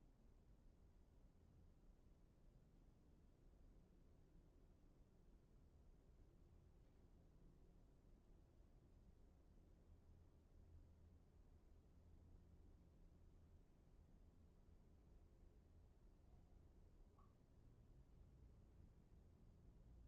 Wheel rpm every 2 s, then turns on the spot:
0, 0, 0, 0, 0, 0, 0, 0, 0, 0.
none